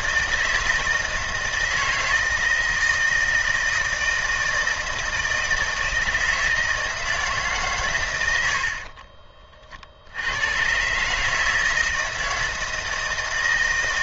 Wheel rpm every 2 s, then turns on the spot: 160, 160, 160, 160, 40, 140, 160.
8-10